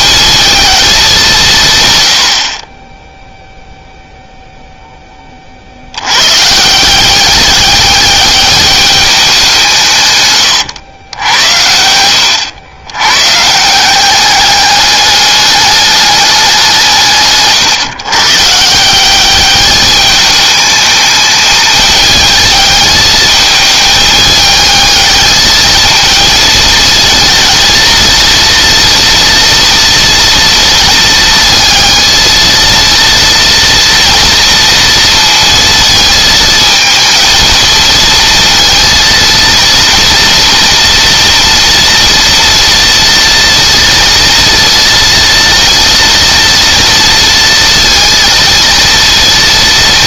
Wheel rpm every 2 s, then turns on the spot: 210, 60, 10, 170, 210, 100, 100, 210, 170, 170, 210, 210, 220, 220, 230, 220, 230, 230, 220, 230, 230, 240, 230, 230, 230.
10-12